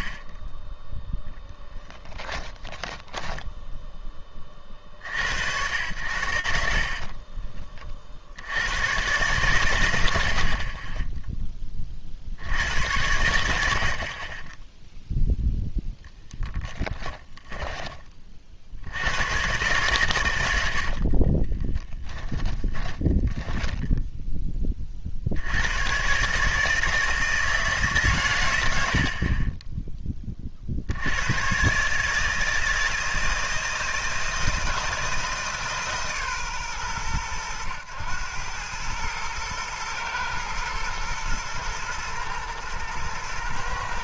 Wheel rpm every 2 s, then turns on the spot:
0, 20, 60, 50, 90, 30, 90, 20, 10, 60, 70, 10, 20, 150, 80, 60, 160, 160, 110, 110, 120, 110.
2-4 16-18 20-24